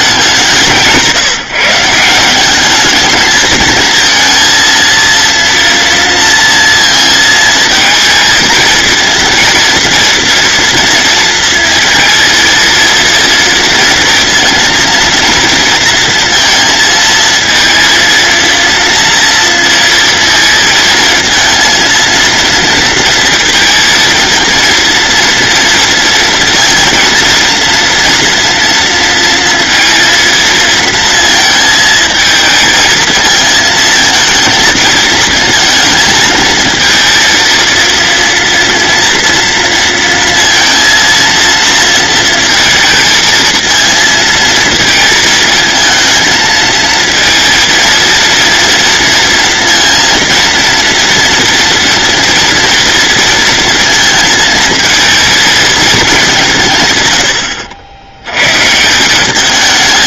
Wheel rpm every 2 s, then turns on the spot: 170, 210, 230, 230, 230, 230, 230, 230, 230, 230, 230, 230, 230, 230, 230, 230, 220, 220, 230, 230, 230, 230, 220, 220, 230, 230, 230, 220, 140, 160.
none